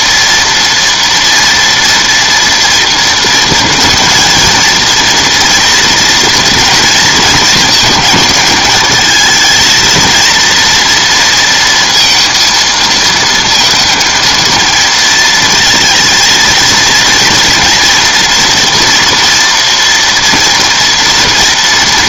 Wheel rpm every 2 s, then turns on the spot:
230, 230, 230, 230, 220, 240, 230, 230, 230, 240, 240.
none